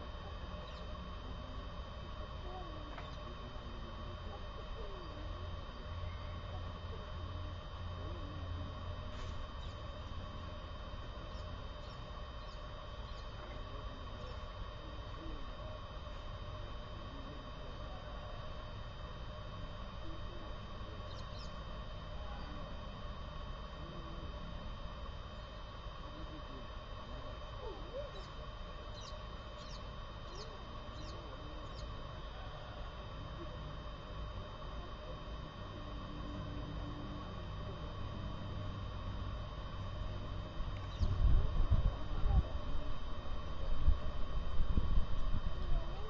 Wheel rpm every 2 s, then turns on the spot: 0, 0, 0, 0, 0, 0, 0, 0, 0, 0, 0, 0, 0, 0, 0, 0, 0, 0, 0, 0, 0, 0, 0.
none